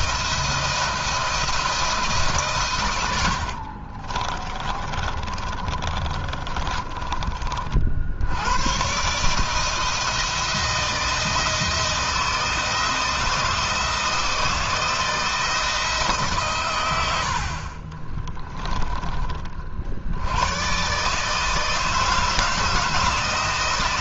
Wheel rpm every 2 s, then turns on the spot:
170, 100, 30, 30, 140, 160, 160, 160, 100, 30, 140, 160.
2-6